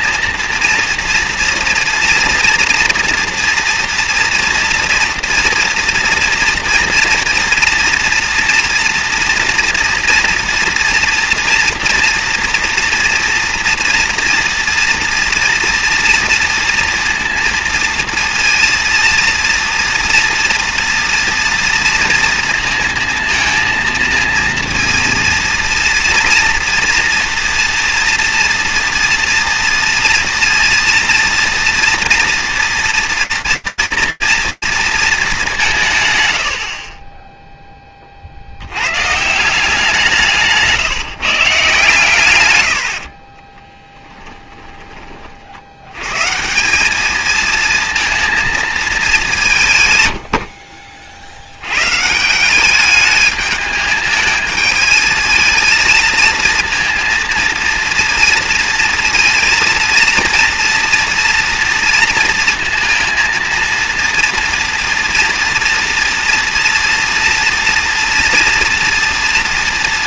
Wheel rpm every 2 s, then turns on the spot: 230, 230, 240, 230, 230, 240, 230, 230, 230, 230, 230, 230, 230, 240, 230, 230, 230, 220, 20, 120, 150, 70, 30, 210, 210, 60, 210, 220, 230, 230, 230, 230, 230, 230, 230.
42-44